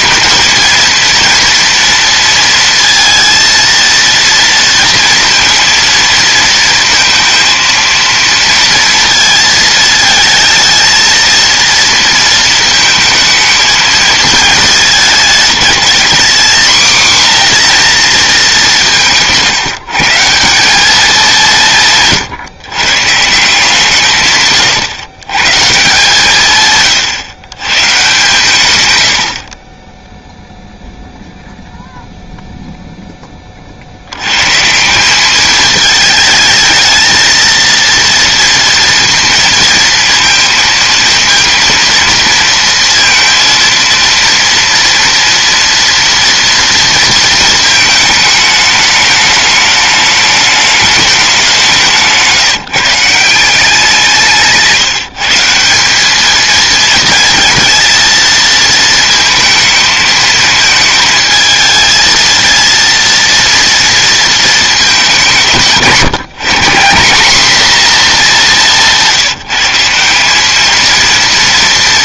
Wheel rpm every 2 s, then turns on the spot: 230, 230, 230, 230, 230, 230, 220, 210, 240, 170, 200, 160, 120, 130, 90, 0, 0, 160, 220, 230, 230, 230, 230, 230, 210, 210, 150, 160, 220, 220, 220, 230, 220, 160, 190, 220.
none